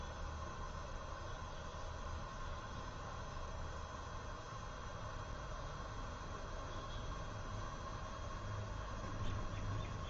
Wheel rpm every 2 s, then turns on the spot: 0, 0, 0, 0, 0.
none